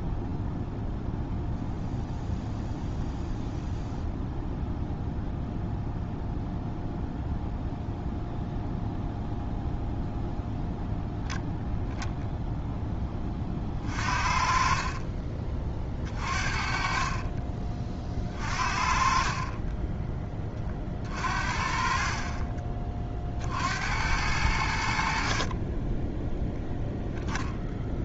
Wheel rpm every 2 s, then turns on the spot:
0, 0, 0, 0, 0, 0, 0, 40, 40, 40, 20, 30, 80, 0.
none